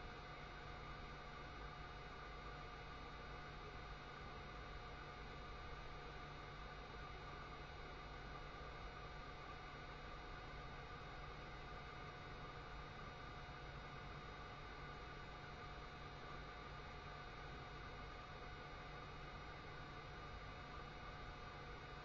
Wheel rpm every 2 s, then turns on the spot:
0, 0, 0, 0, 0, 0, 0, 0, 0, 0, 0.
none